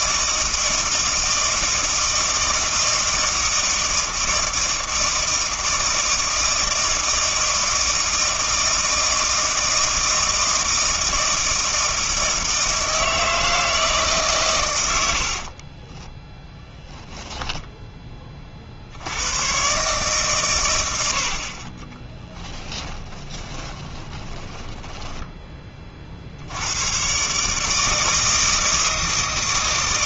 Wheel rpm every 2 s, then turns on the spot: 160, 160, 160, 160, 160, 160, 160, 100, 20, 60, 100, 10, 10, 100, 160.
22-26